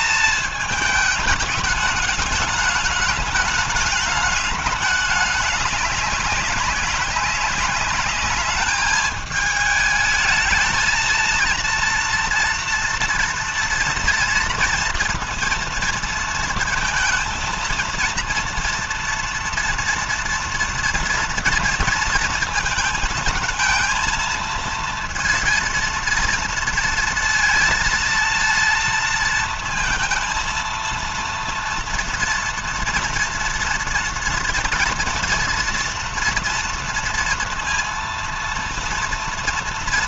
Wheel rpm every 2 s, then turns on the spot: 210, 210, 210, 190, 210, 220, 240, 230, 230, 230, 230, 220, 230, 230, 230, 230, 230, 240, 230, 230.
none